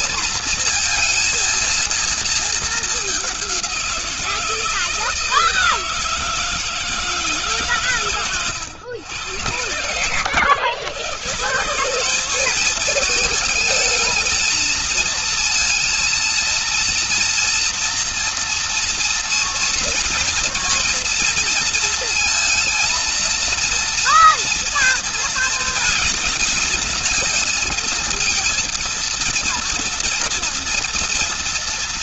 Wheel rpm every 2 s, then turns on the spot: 230, 220, 160, 160, 110, 110, 210, 230, 230, 230, 230, 230, 230, 230, 230, 230.
none